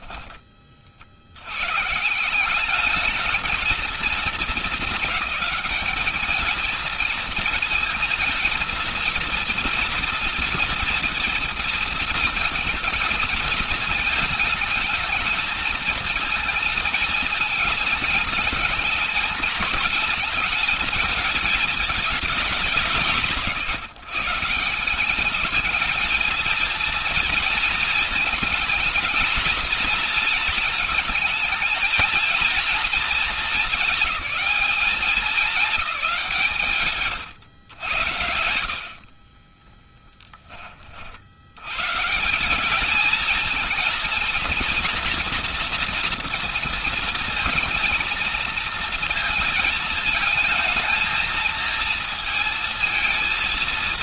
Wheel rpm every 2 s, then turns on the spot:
30, 200, 220, 220, 230, 230, 220, 220, 220, 200, 210, 180, 160, 220, 230, 230, 220, 210, 170, 70, 40, 210, 230, 230, 230, 220, 220.
38-40